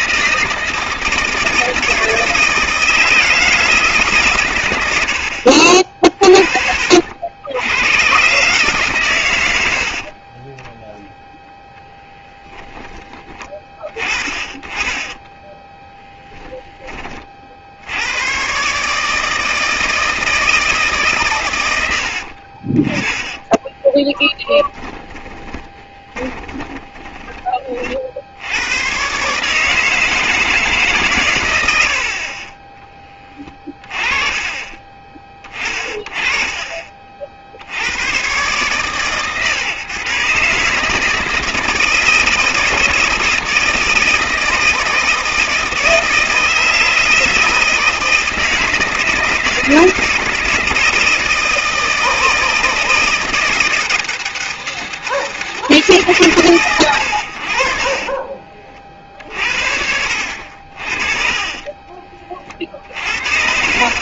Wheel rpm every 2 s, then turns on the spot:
160, 160, 70, 80, 110, 0, 20, 10, 20, 150, 140, 20, 20, 20, 110, 150, 20, 20, 40, 130, 150, 160, 160, 160, 160, 160, 160, 160, 120, 50, 50, 60.
22-28